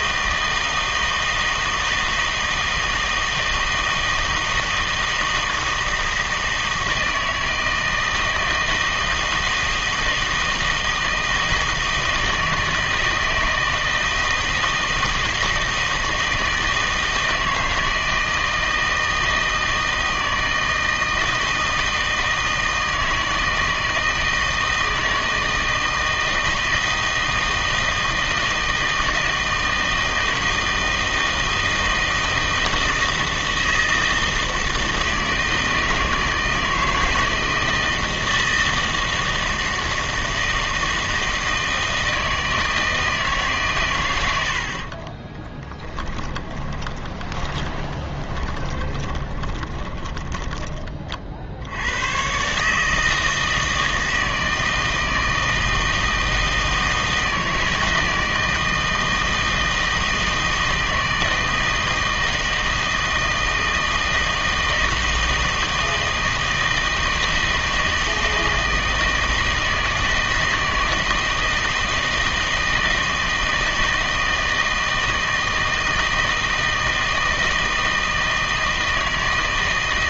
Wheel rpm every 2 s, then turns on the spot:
160, 160, 160, 160, 160, 160, 160, 160, 160, 160, 160, 160, 160, 160, 160, 160, 160, 160, 160, 160, 160, 160, 80, 20, 20, 20, 150, 160, 160, 160, 160, 160, 160, 160, 160, 160, 160, 160, 160, 160.
46-50